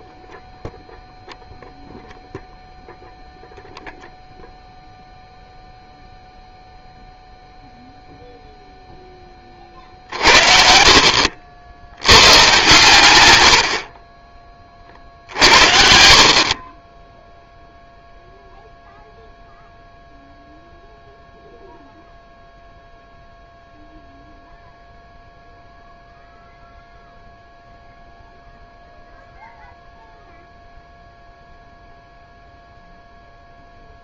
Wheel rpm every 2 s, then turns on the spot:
0, 0, 0, 0, 20, 70, 100, 70, 0, 0, 0, 0, 0, 0, 0, 0, 0.
none